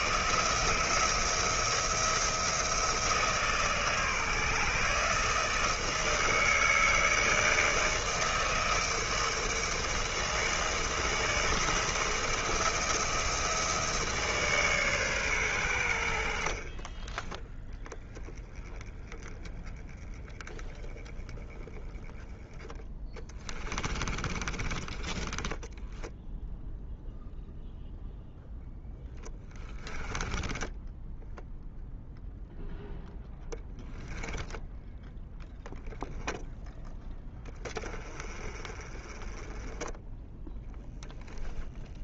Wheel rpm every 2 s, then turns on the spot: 170, 170, 160, 160, 160, 160, 170, 140, 30, 10, 10, 10, 30, 0, 10, 10, 0, 10, 10, 30, 0.
16-18 22-26 34-36